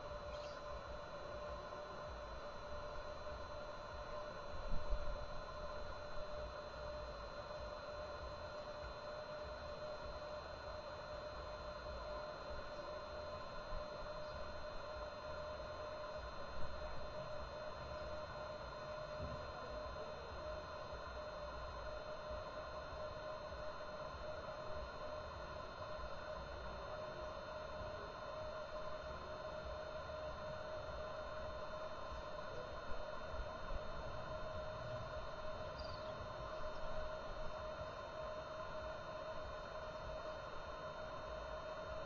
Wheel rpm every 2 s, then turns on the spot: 0, 0, 0, 0, 0, 0, 0, 0, 0, 0, 0, 0, 0, 0, 0, 0, 0, 0, 0, 0, 0.
none